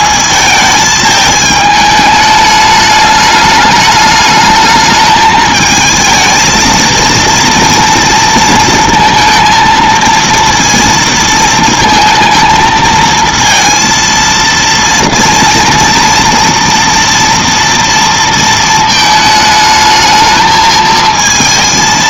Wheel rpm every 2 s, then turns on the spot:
220, 210, 210, 230, 230, 230, 220, 230, 230, 230, 220.
none